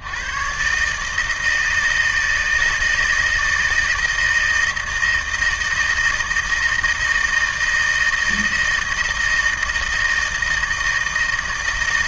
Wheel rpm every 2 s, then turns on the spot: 130, 160, 160, 160, 160, 160.
none